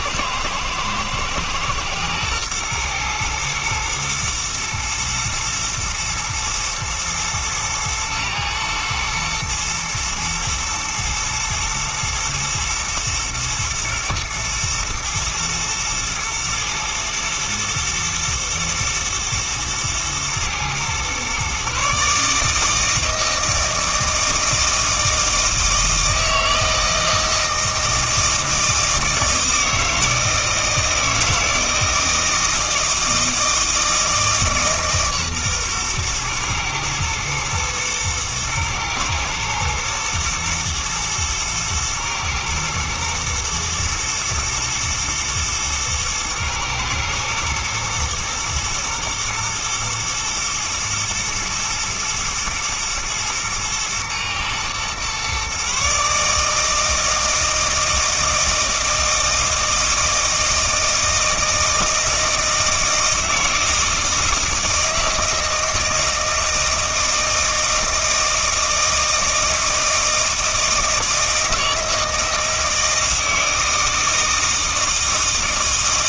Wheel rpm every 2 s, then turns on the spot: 120, 120, 120, 110, 110, 110, 110, 110, 110, 110, 120, 160, 160, 160, 160, 160, 160, 150, 110, 110, 110, 110, 110, 120, 120, 120, 110, 120, 160, 160, 160, 160, 160, 160, 160, 160, 160, 160.
none